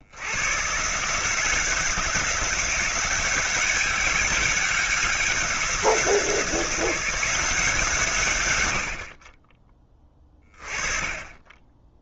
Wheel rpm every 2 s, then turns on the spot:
140, 180, 190, 170, 80, 30.
none